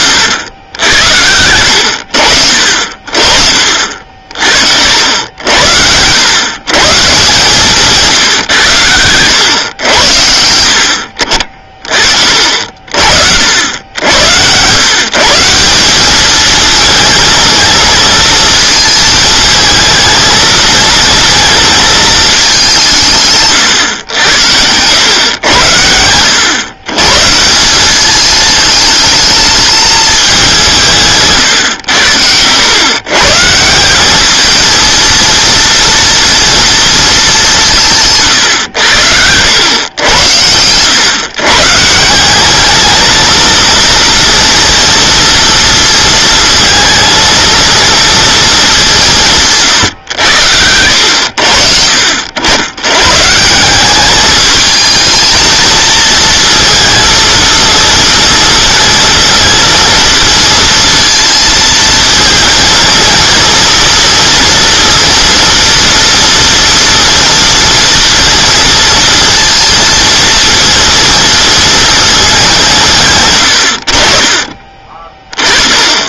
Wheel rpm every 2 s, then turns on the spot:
100, 60, 70, 120, 110, 70, 60, 120, 230, 220, 230, 190, 100, 120, 220, 180, 110, 220, 230, 90, 100, 210, 230, 230, 200, 100, 100, 220, 230, 230, 230, 230, 230, 230, 230, 230, 160, 30.
none